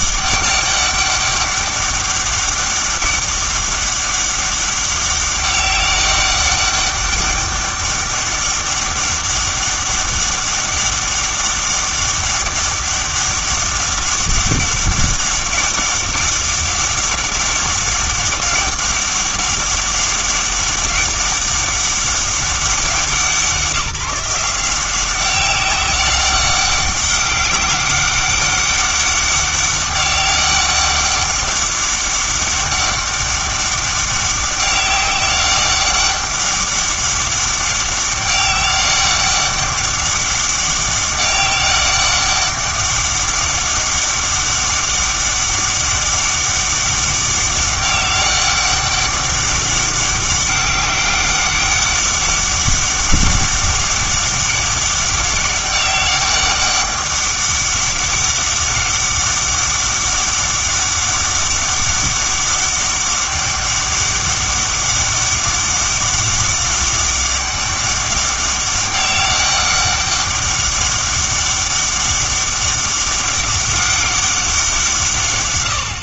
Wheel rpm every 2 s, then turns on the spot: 200, 200, 200, 190, 200, 200, 200, 200, 200, 200, 200, 190, 180, 200, 200, 200, 200, 190, 200, 190, 200, 200, 200, 200, 200, 200, 200, 200, 200, 200, 200, 200, 200, 200, 200, 200, 200, 180.
none